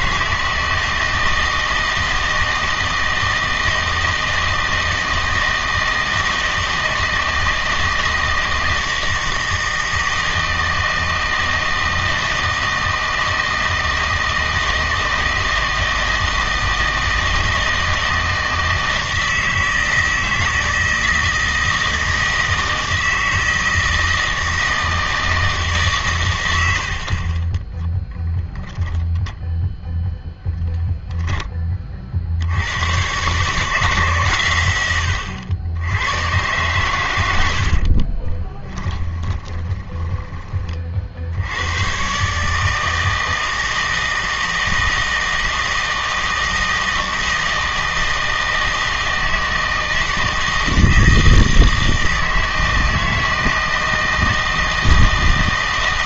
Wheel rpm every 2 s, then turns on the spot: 160, 160, 160, 160, 160, 160, 160, 160, 160, 160, 160, 160, 160, 80, 0, 0, 100, 100, 120, 20, 40, 160, 160, 160, 160, 160, 160, 160.
38-40